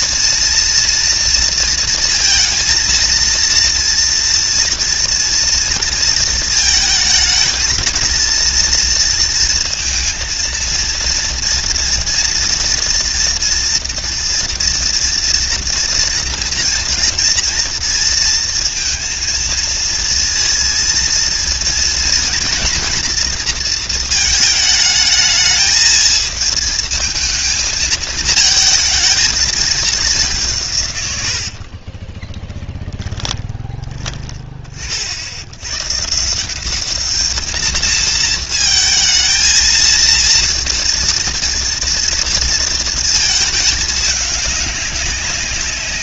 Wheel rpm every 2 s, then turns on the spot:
230, 230, 230, 220, 230, 230, 230, 230, 230, 230, 230, 230, 220, 220, 220, 160, 10, 30, 180, 220, 230, 230, 200.
32-34